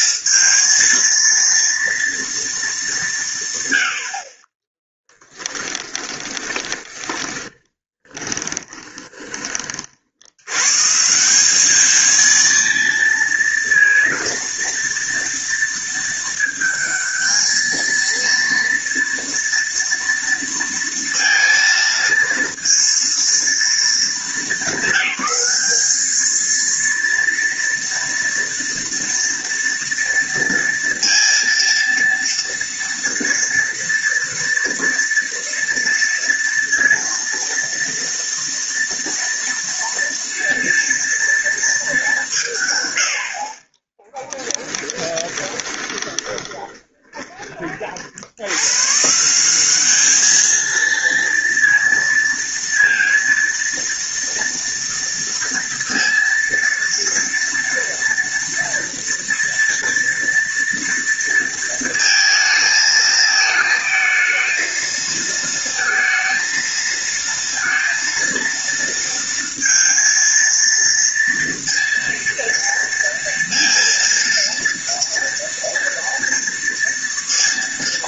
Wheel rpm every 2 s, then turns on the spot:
230, 200, 20, 20, 20, 150, 230, 230, 220, 230, 230, 230, 210, 230, 230, 230, 230, 230, 230, 230, 230, 110, 10, 20, 130, 220, 230, 230, 230, 240, 230, 220, 230, 220, 230, 230, 230, 230, 230.
4-10 44-48